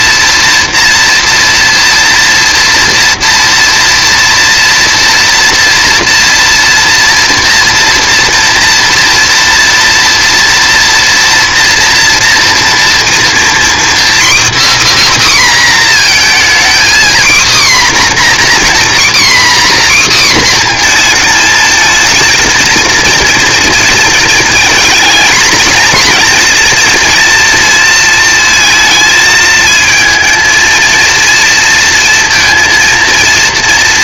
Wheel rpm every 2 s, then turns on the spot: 240, 230, 230, 230, 230, 230, 230, 300, 250, 260, 240, 230, 230, 230, 220, 230, 230.
none